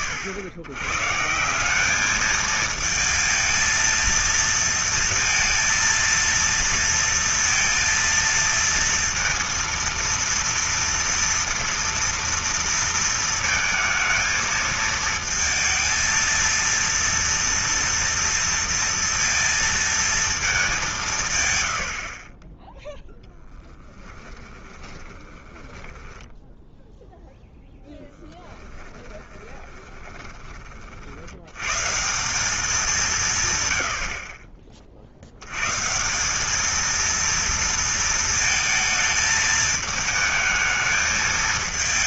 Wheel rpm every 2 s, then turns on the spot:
120, 220, 230, 230, 230, 230, 230, 220, 230, 230, 210, 10, 20, 0, 30, 40, 190, 50, 220, 220, 220.
24-26 28-30